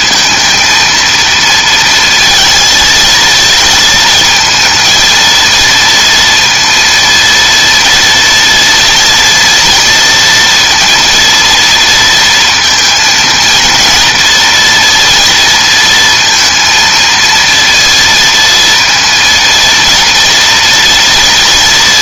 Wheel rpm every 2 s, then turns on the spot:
230, 230, 220, 230, 230, 230, 230, 230, 230, 230, 230.
none